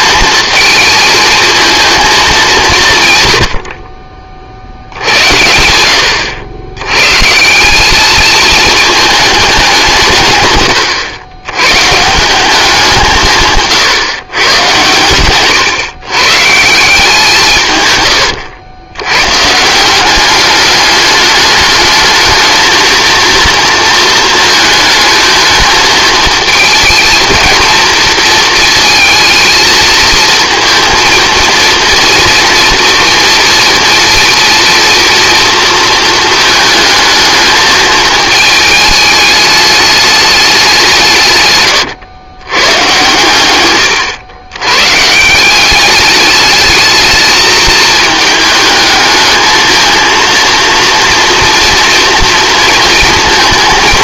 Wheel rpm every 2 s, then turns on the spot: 220, 170, 60, 100, 220, 110, 190, 130, 150, 90, 200, 230, 220, 220, 230, 220, 230, 230, 220, 210, 190, 110, 110, 210, 220, 230, 230.
none